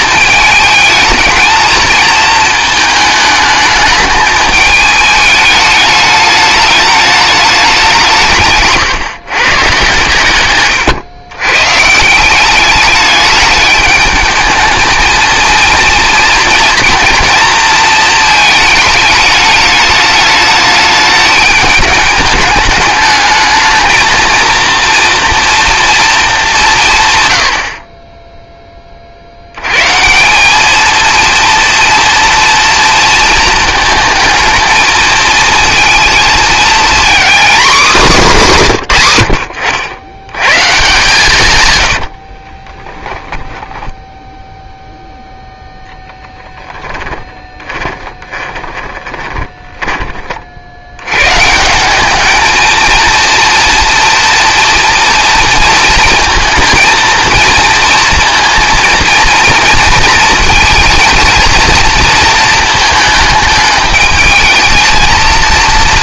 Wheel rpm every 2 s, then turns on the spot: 220, 220, 210, 210, 140, 120, 200, 220, 230, 220, 210, 210, 230, 160, 20, 210, 230, 220, 230, 160, 140, 20, 0, 10, 20, 80, 230, 230, 220, 230, 230, 220, 220.
10-12 42-44 46-50